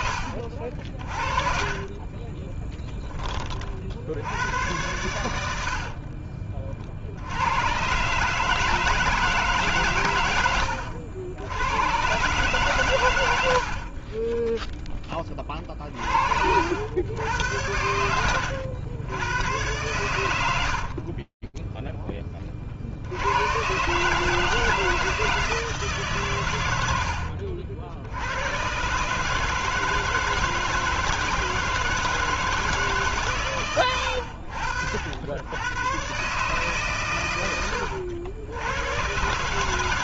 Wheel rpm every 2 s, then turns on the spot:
50, 30, 90, 40, 150, 90, 140, 20, 70, 90, 80, 80, 160, 70, 140, 160, 150, 80, 110, 130.
0-4 20-22